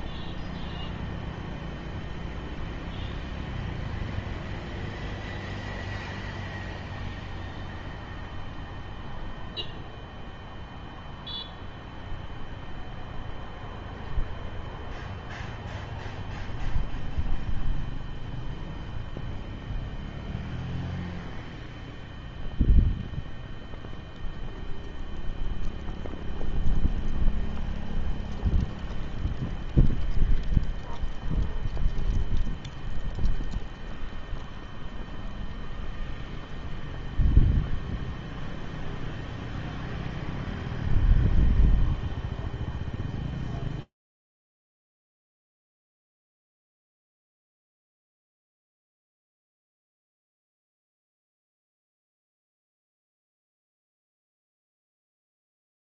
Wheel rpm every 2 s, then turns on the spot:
0, 0, 0, 0, 0, 0, 0, 0, 0, 0, 0, 0, 0, 0, 0, 0, 0, 0, 0, 0, 0, 0, 0, 0, 0, 0, 0, 0.
none